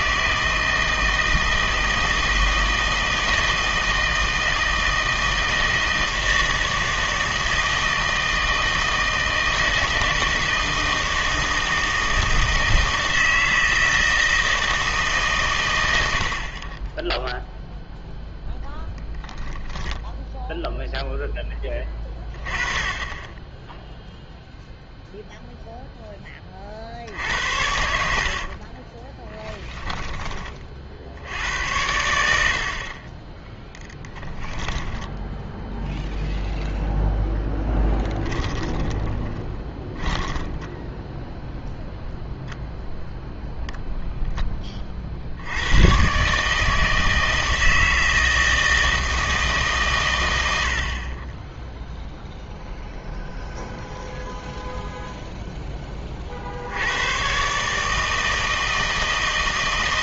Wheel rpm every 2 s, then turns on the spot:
160, 160, 160, 160, 160, 160, 160, 160, 30, 10, 0, 20, 0, 50, 30, 40, 60, 10, 0, 20, 10, 0, 20, 150, 160, 70, 0, 0, 80, 160.
18-20 28-30 38-42